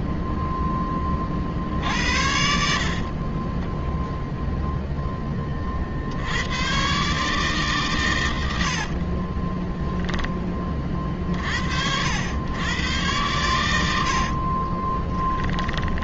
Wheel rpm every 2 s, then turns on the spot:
0, 70, 0, 80, 90, 20, 100, 40.
2-4 8-10 14-16